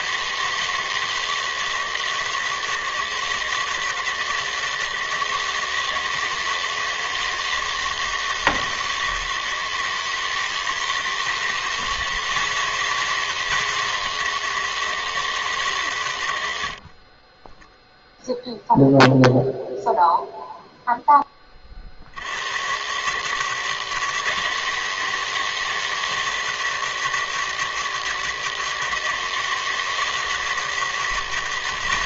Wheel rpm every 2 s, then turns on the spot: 160, 160, 160, 160, 160, 180, 190, 120, 0, 0, 80, 160, 160, 160, 160, 190.
none